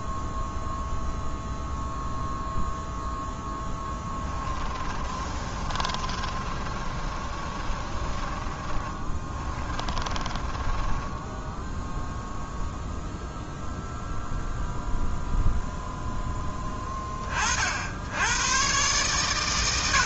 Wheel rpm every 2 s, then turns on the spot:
0, 0, 30, 30, 30, 10, 0, 0, 20, 120.
4-12